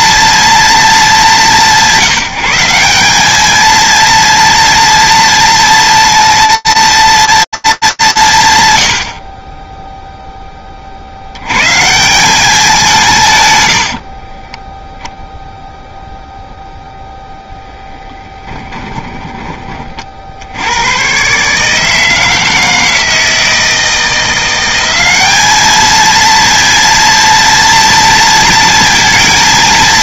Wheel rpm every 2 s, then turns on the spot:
220, 190, 230, 230, 170, 10, 190, 10, 0, 10, 110, 160, 190, 230, 230.
14-16 18-20